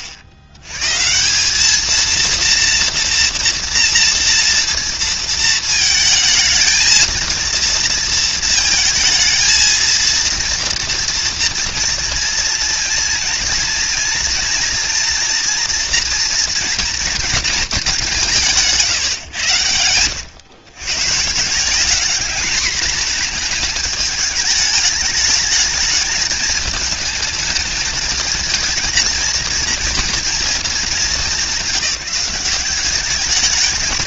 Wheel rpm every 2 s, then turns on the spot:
70, 230, 230, 220, 230, 230, 230, 230, 230, 170, 130, 220, 210, 220, 230, 210, 180.
none